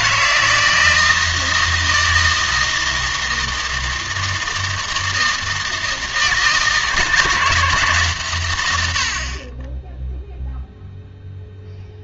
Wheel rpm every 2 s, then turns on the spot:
160, 160, 160, 160, 110, 0.
none